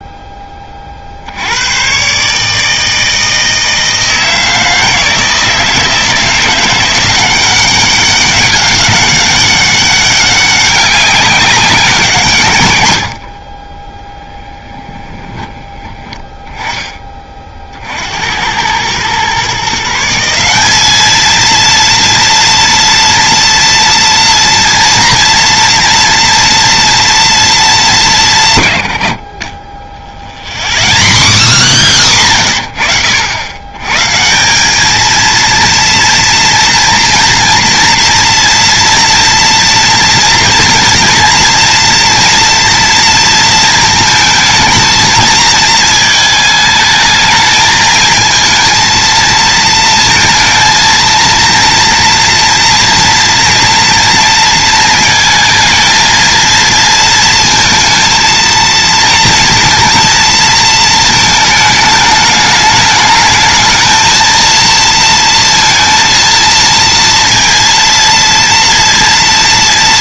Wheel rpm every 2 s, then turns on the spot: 50, 160, 160, 180, 200, 200, 90, 30, 20, 110, 210, 240, 240, 230, 90, 0, 40, 210, 230, 230, 240, 230, 220, 220, 230, 230, 230, 220, 230, 230, 220, 210, 230, 230, 230.
14-16